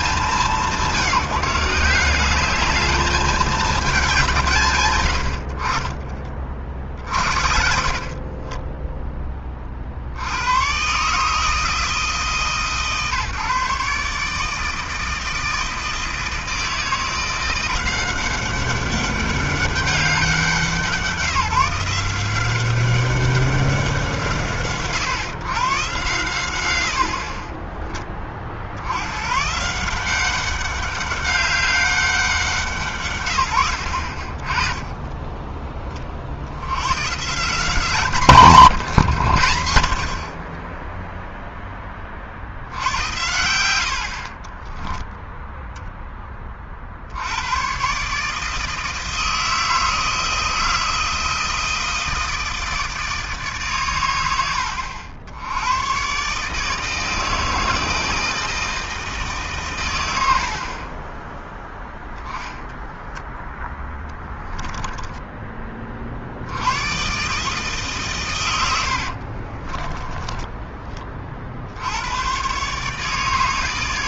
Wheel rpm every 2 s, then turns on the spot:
170, 220, 50, 80, 20, 150, 140, 160, 170, 200, 170, 200, 130, 40, 130, 200, 120, 10, 180, 120, 0, 80, 0, 110, 160, 160, 150, 100, 160, 140, 10, 10, 20, 150, 40, 50, 150.
6-8 60-62 68-70